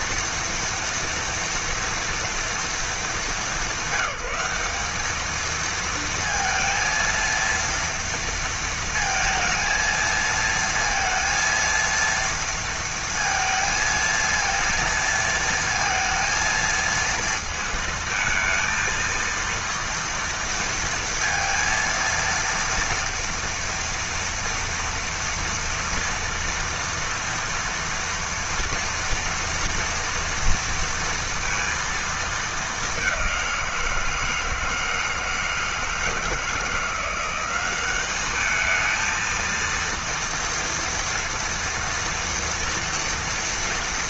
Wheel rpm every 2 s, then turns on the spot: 230, 240, 190, 230, 230, 230, 230, 230, 230, 220, 230, 230, 230, 230, 230, 230, 220, 170, 160, 200, 230, 230.
none